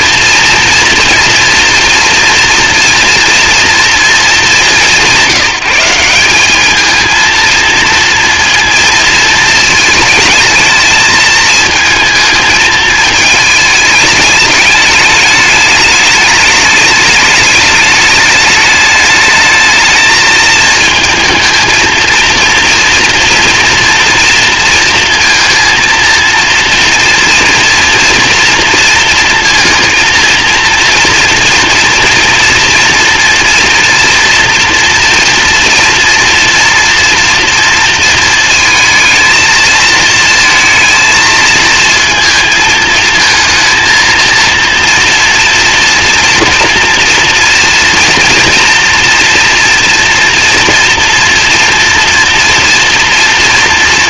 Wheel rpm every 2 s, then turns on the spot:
230, 230, 200, 210, 230, 220, 220, 210, 210, 210, 220, 230, 230, 230, 230, 230, 230, 230, 230, 230, 220, 220, 230, 230, 230, 230, 240.
none